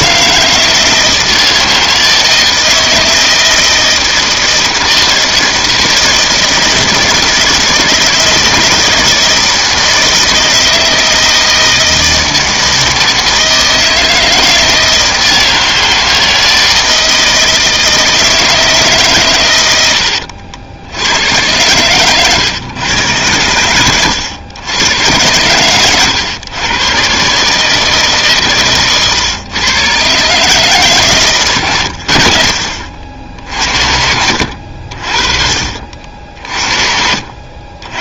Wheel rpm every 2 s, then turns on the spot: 160, 160, 160, 160, 160, 160, 160, 160, 160, 160, 70, 120, 100, 110, 130, 150, 60, 60, 50.
none